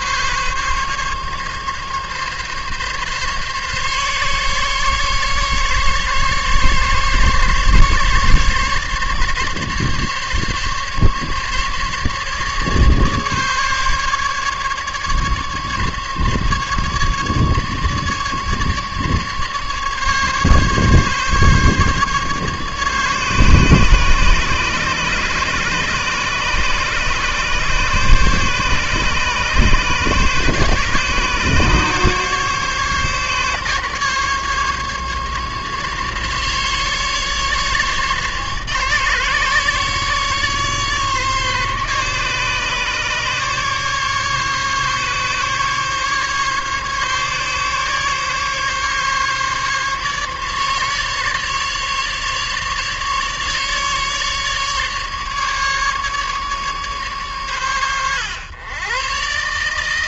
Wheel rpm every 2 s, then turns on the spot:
140, 140, 140, 140, 140, 140, 150, 140, 150, 150, 140, 140, 140, 140, 140, 140, 140, 140, 150, 140, 140, 140, 140, 140, 150, 150, 150, 140, 140, 120.
none